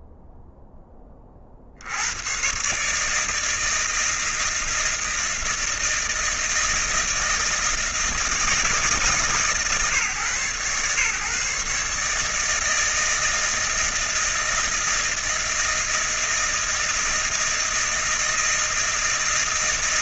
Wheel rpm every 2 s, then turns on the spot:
0, 130, 160, 160, 150, 120, 160, 160, 160, 160.
none